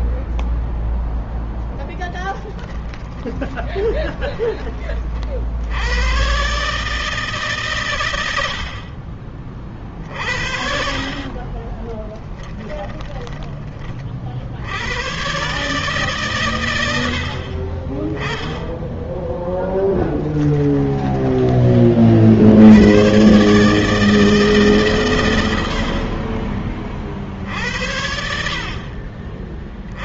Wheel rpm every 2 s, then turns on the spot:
0, 10, 40, 150, 40, 40, 10, 100, 100, 10, 10, 100, 120, 40, 40.
2-4 10-12 20-22